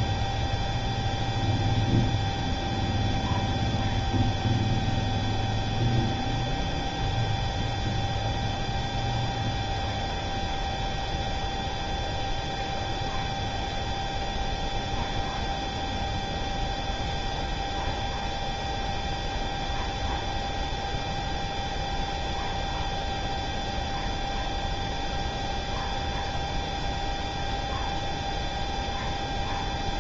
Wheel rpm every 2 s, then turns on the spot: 0, 0, 0, 0, 0, 0, 0, 0, 0, 0, 0, 0, 0, 0, 0.
none